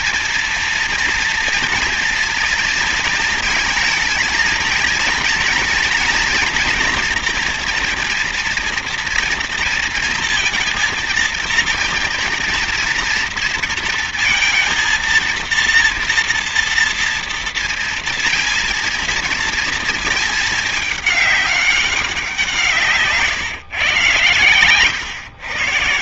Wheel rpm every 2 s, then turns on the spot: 230, 220, 230, 240, 240, 230, 230, 220, 230, 230, 210, 160, 120.
none